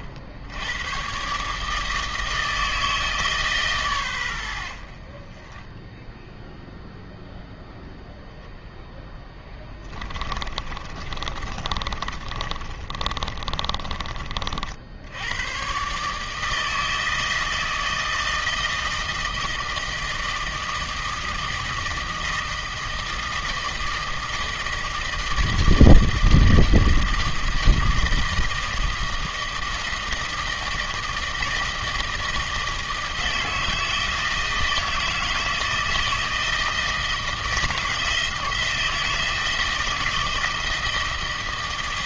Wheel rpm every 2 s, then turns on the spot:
80, 160, 80, 0, 0, 30, 30, 60, 160, 160, 160, 160, 160, 160, 160, 160, 160, 160, 160, 160, 160.
10-14